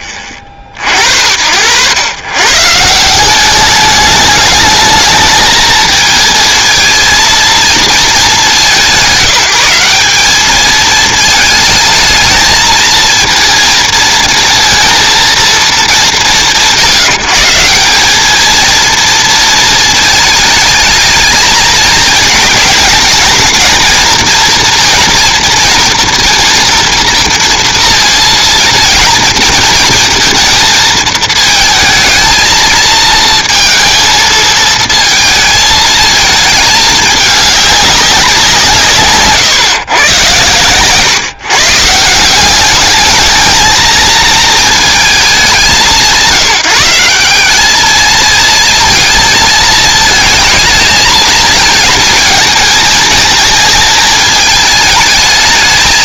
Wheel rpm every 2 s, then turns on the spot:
50, 160, 220, 230, 170, 220, 220, 230, 150, 230, 220, 220, 230, 230, 220, 220, 220, 230, 210, 160, 130, 210, 220, 170, 220, 220, 220, 220.
none